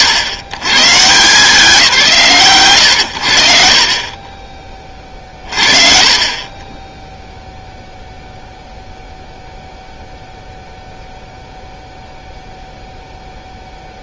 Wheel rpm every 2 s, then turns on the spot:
120, 100, 20, 30, 0, 0, 0.
none